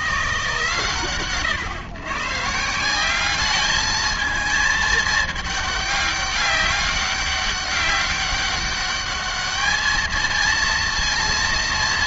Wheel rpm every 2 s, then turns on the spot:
150, 150, 220, 200, 200, 230.
none